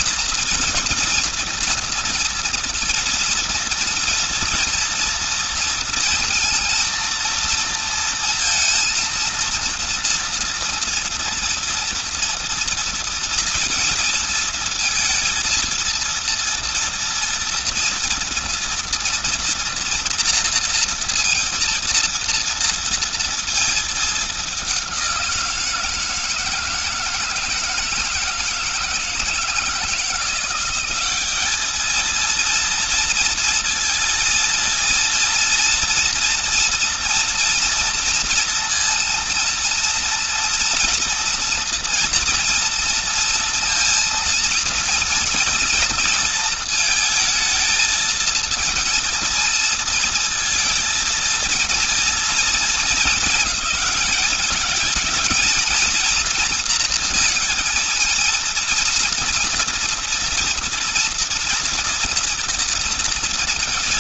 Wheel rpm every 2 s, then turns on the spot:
240, 230, 230, 220, 230, 230, 230, 230, 230, 230, 230, 230, 200, 160, 160, 190, 230, 230, 230, 230, 230, 230, 230, 230, 230, 230, 220, 220, 230, 230, 230, 230.
none